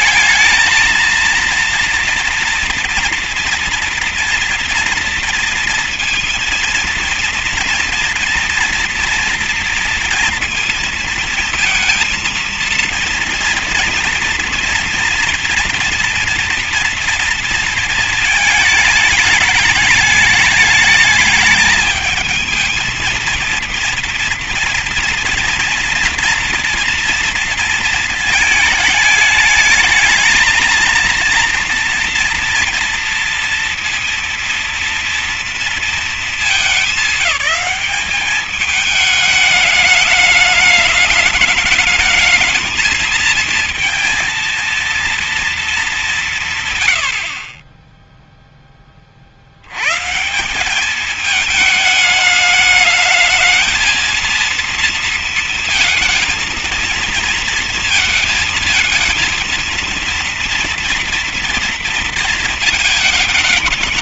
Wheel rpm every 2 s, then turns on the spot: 220, 230, 230, 230, 230, 230, 230, 240, 230, 220, 210, 220, 230, 230, 220, 220, 230, 230, 220, 210, 210, 210, 230, 170, 10, 170, 220, 230, 230, 230, 230, 230.
none